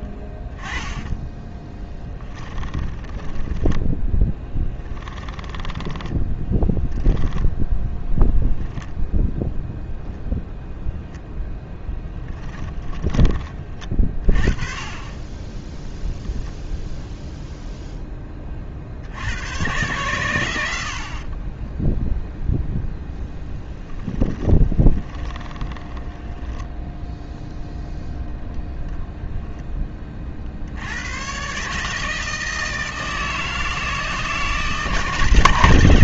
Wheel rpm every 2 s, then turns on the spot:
10, 10, 10, 10, 0, 0, 10, 30, 0, 40, 70, 0, 10, 0, 0, 90, 160, 150.
0-6 24-26